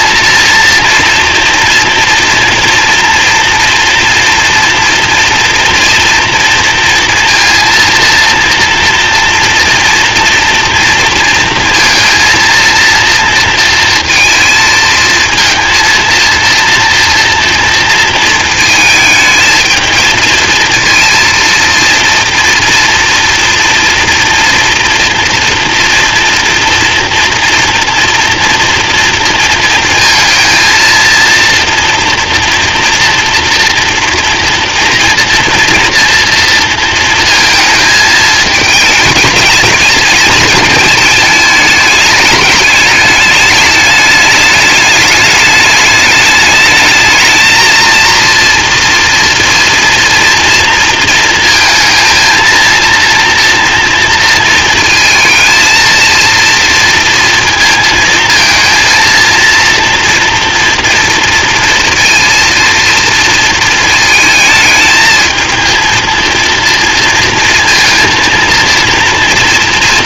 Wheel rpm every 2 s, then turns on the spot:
230, 230, 230, 230, 230, 230, 230, 220, 230, 220, 230, 230, 230, 240, 230, 230, 230, 230, 230, 220, 230, 210, 210, 210, 230, 230, 230, 230, 230, 230, 230, 230, 220, 230, 230.
none